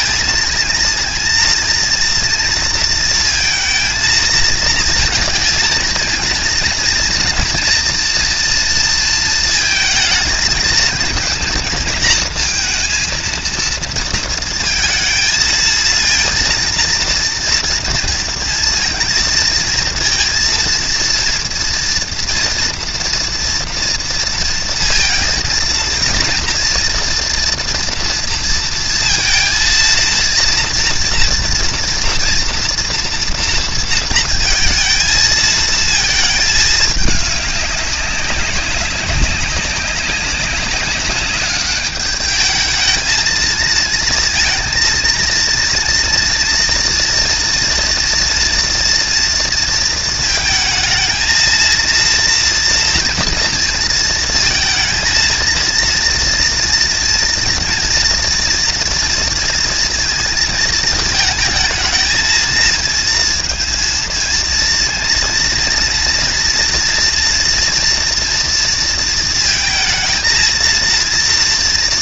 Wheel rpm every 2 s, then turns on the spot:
230, 230, 220, 230, 230, 230, 230, 220, 230, 230, 230, 230, 230, 240, 230, 230, 240, 220, 210, 200, 200, 220, 230, 230, 240, 220, 230, 220, 230, 230, 220, 230, 230, 230, 230, 230.
none